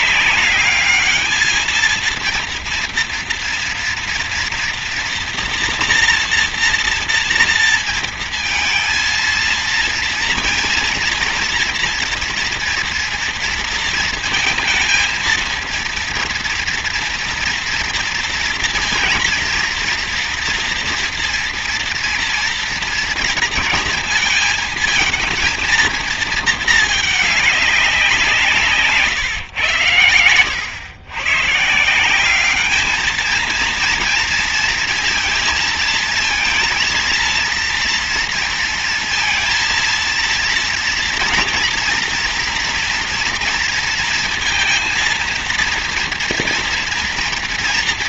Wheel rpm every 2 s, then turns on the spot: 210, 230, 240, 240, 230, 230, 230, 230, 230, 230, 230, 230, 230, 210, 140, 110, 220, 230, 230, 230, 230, 230, 230, 230.
none